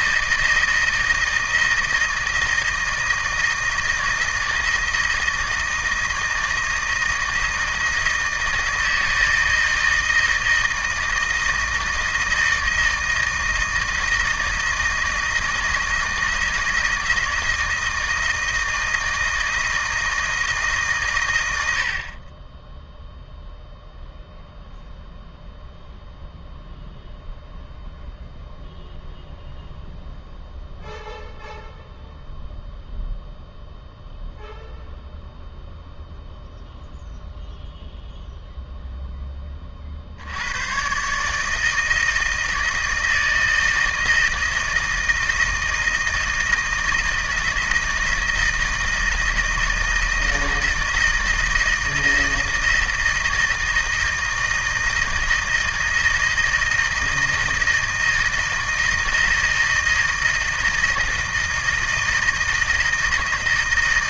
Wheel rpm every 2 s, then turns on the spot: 160, 160, 160, 160, 160, 160, 160, 160, 160, 160, 140, 10, 0, 0, 0, 0, 0, 0, 0, 0, 120, 160, 160, 160, 160, 160, 160, 160, 160, 170, 160, 160.
none